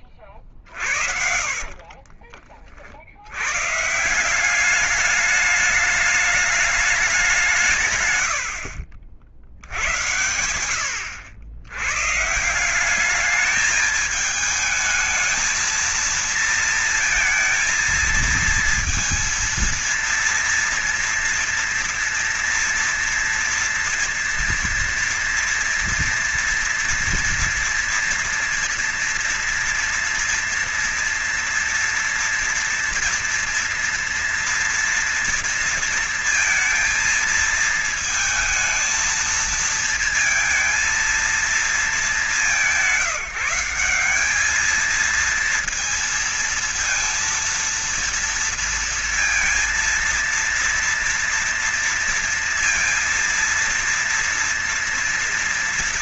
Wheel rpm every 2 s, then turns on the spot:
30, 40, 190, 200, 80, 90, 180, 220, 230, 230, 230, 230, 230, 230, 230, 230, 230, 230, 230, 220, 230, 210, 210, 230, 230, 230, 230, 230.
0-2